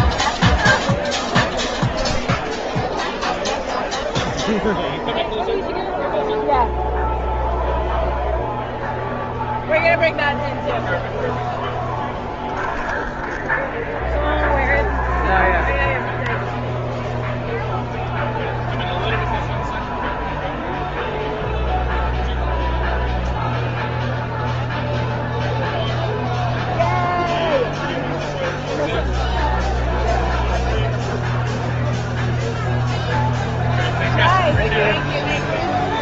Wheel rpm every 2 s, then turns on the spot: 0, 0, 0, 0, 0, 0, 0, 0, 0, 0, 0, 0, 0, 0, 0, 0, 0, 0.
none